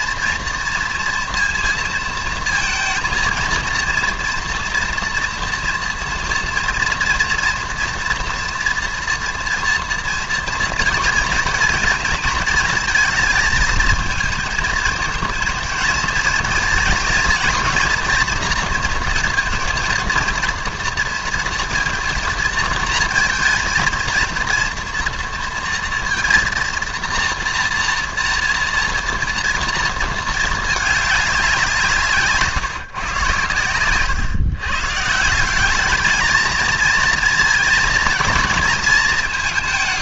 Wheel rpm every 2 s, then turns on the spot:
230, 230, 230, 230, 230, 230, 230, 220, 230, 230, 230, 230, 230, 230, 230, 220, 140, 140, 220, 220.
none